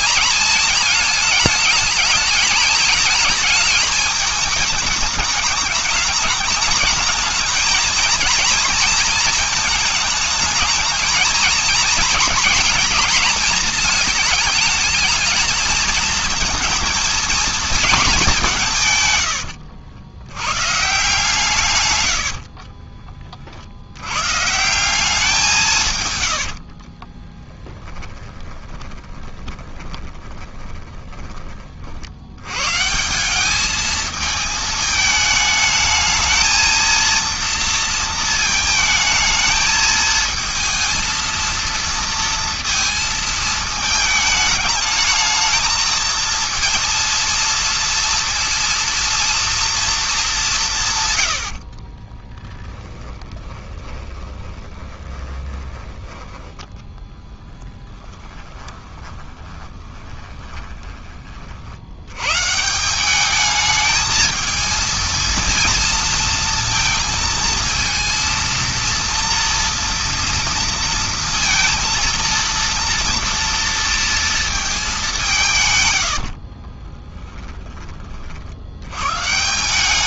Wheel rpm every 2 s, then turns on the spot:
220, 220, 220, 220, 230, 220, 220, 220, 230, 170, 120, 40, 160, 70, 20, 20, 120, 220, 230, 220, 220, 230, 210, 230, 230, 180, 10, 20, 10, 20, 20, 160, 220, 230, 230, 230, 230, 220, 50, 80.
22-24 26-32 52-56 58-62 76-78